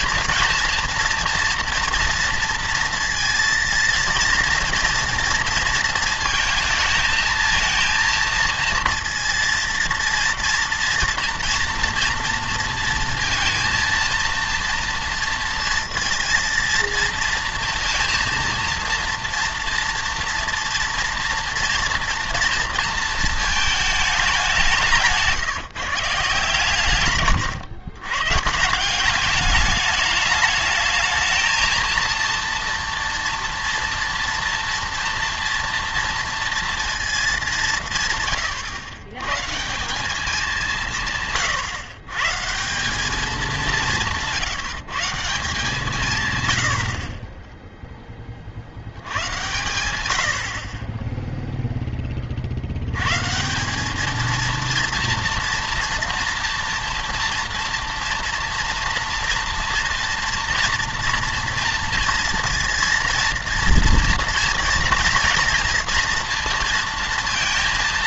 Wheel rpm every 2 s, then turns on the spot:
230, 230, 230, 220, 230, 230, 230, 230, 230, 230, 240, 230, 180, 130, 180, 210, 230, 230, 230, 110, 180, 180, 150, 90, 80, 30, 80, 230, 240, 240, 230, 230, 230, 230.
none